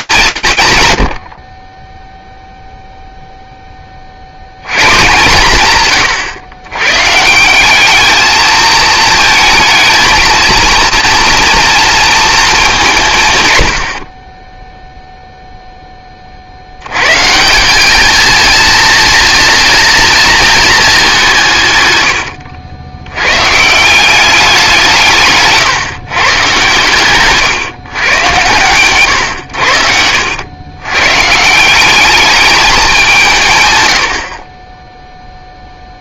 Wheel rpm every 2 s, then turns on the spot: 150, 0, 140, 120, 220, 240, 190, 0, 100, 240, 200, 100, 150, 130, 120, 130, 180, 0.
none